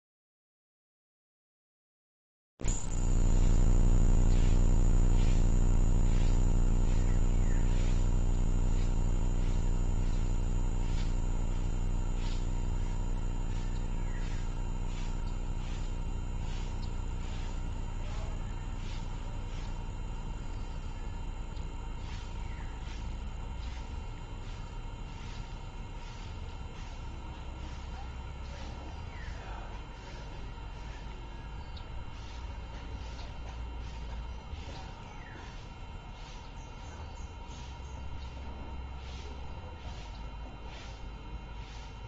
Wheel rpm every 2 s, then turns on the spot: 0, 0, 0, 0, 0, 0, 0, 0, 0, 0, 0, 0, 0, 0, 0, 0, 0, 0, 0, 0, 0.
none